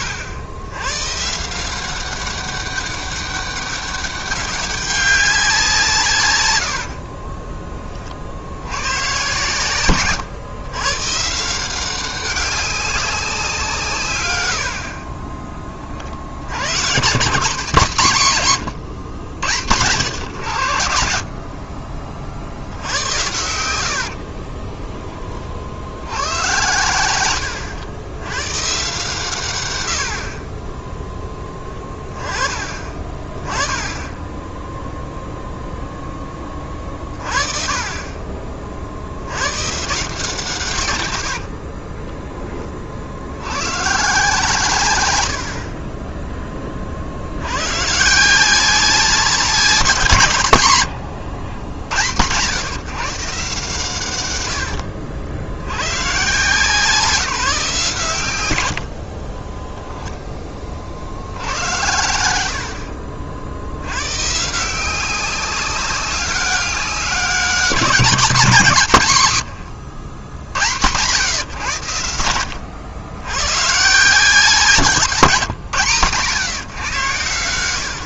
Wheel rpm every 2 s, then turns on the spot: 110, 200, 200, 60, 110, 130, 190, 50, 110, 110, 90, 90, 20, 100, 140, 10, 30, 0, 30, 50, 120, 30, 130, 40, 180, 100, 140, 80, 170, 70, 50, 70, 170, 190, 150, 100, 100, 180, 120.
6-8 18-20 50-52 58-60 74-76